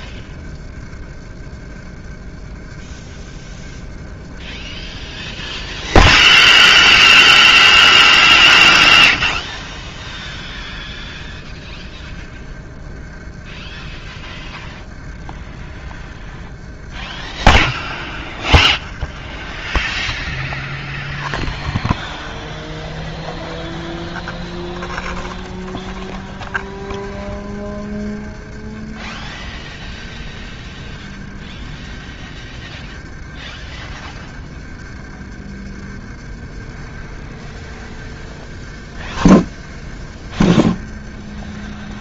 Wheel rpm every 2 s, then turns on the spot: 30, 30, 30, 30, 30, 30, 30, 30, 30, 30, 10, 30, 20, 30, 30, 30, 30, 30, 30, 30, 30.
none